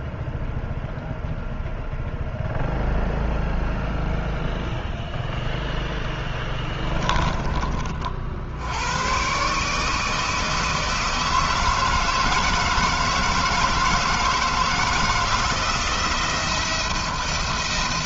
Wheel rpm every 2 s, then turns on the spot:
0, 0, 0, 30, 100, 160, 160, 170, 170.
none